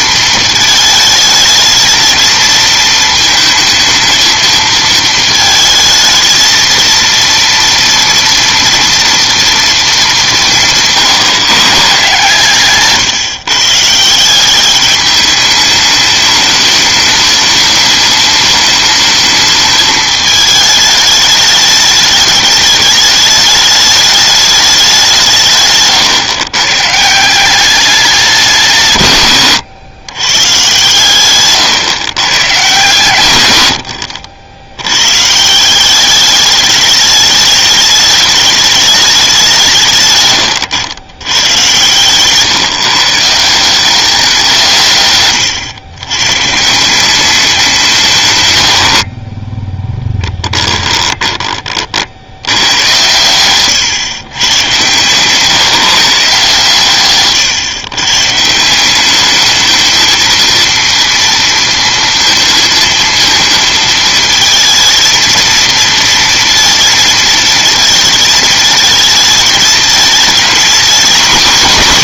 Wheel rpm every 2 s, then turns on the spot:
220, 220, 220, 230, 230, 170, 140, 190, 210, 210, 210, 210, 210, 120, 170, 120, 120, 90, 210, 210, 100, 140, 170, 140, 100, 10, 100, 120, 150, 160, 230, 230, 230, 230, 220, 230.
50-52